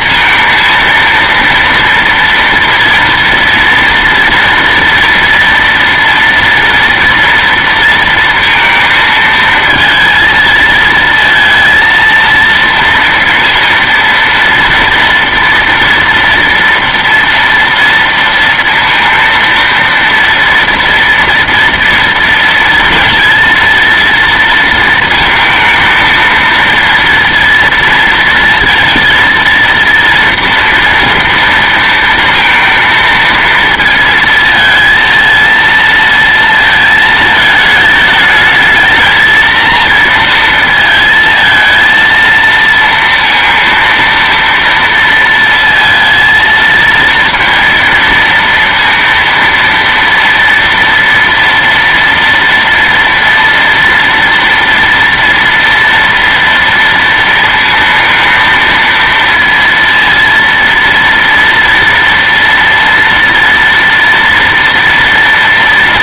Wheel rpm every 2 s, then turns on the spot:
230, 230, 230, 230, 230, 220, 230, 230, 240, 230, 240, 230, 230, 230, 230, 230, 230, 230, 230, 220, 230, 230, 230, 230, 230, 230, 230, 230, 230, 230, 230, 230, 230.
none